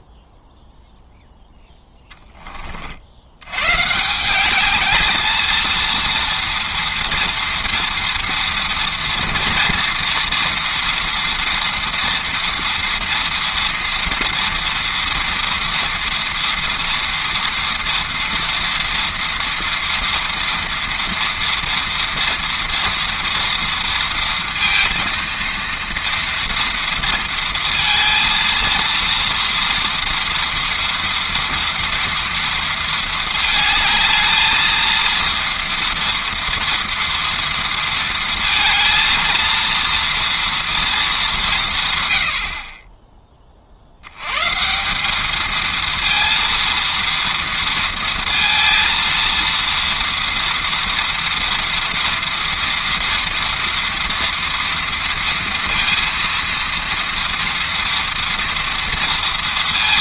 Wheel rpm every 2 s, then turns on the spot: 0, 40, 210, 230, 230, 230, 230, 230, 230, 230, 230, 230, 230, 230, 230, 230, 230, 220, 230, 230, 230, 30, 170, 230, 230, 230, 230, 230, 230, 230.
none